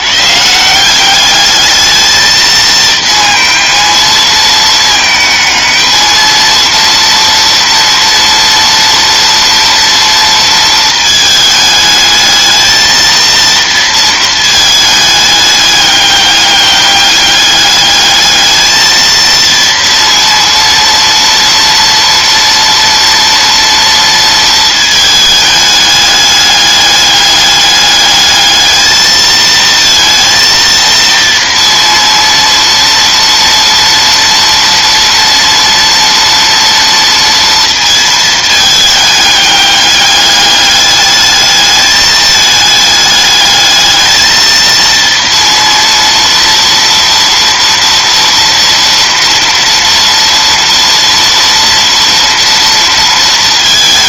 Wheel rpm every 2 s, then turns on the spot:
160, 220, 220, 230, 240, 220, 220, 220, 200, 220, 230, 230, 220, 210, 220, 230, 230, 230, 230, 210, 210, 210, 230, 230, 230, 230, 230.
none